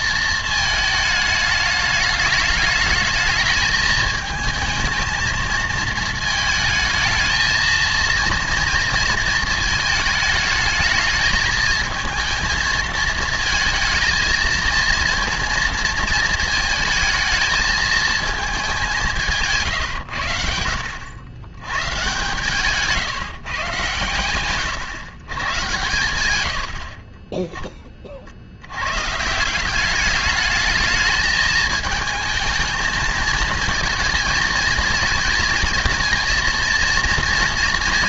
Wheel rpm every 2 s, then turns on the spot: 230, 210, 220, 220, 230, 220, 220, 220, 230, 220, 80, 150, 120, 110, 50, 200, 220, 230, 230.
none